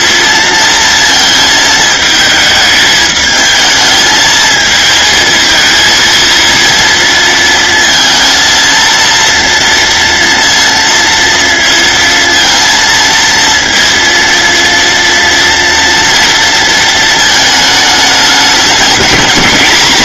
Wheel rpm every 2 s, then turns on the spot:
230, 210, 220, 230, 230, 230, 230, 230, 230, 210.
none